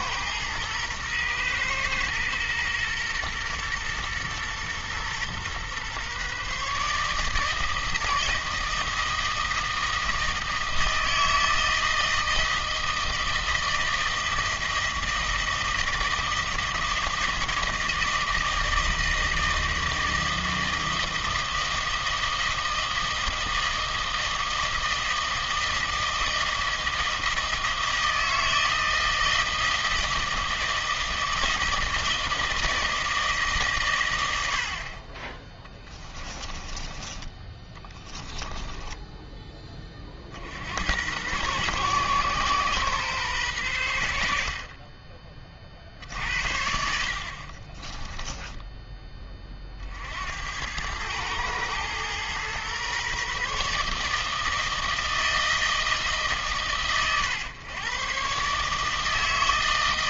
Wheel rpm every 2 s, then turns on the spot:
120, 120, 120, 140, 160, 160, 160, 160, 160, 160, 160, 160, 160, 160, 160, 160, 160, 60, 20, 10, 70, 130, 40, 60, 10, 90, 130, 160, 130, 140.
36-40 48-50